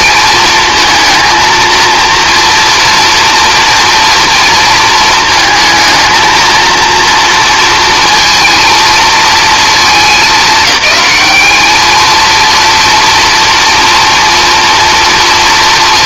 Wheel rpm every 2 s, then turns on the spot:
230, 230, 230, 230, 230, 200, 230, 230.
none